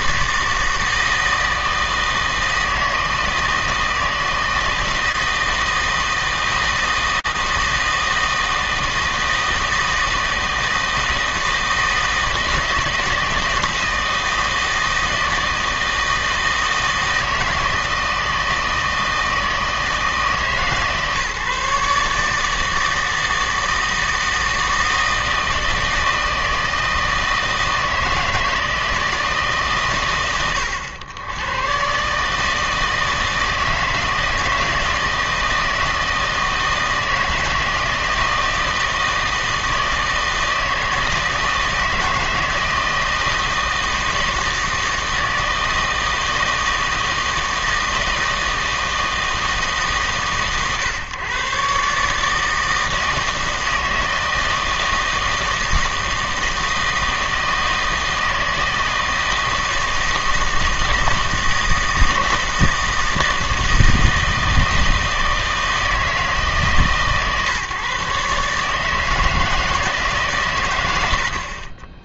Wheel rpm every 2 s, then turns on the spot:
160, 160, 160, 160, 160, 160, 160, 160, 160, 160, 150, 160, 160, 160, 160, 100, 160, 160, 160, 160, 160, 160, 160, 160, 160, 130, 160, 160, 160, 160, 160, 160, 160, 150, 150, 100.
none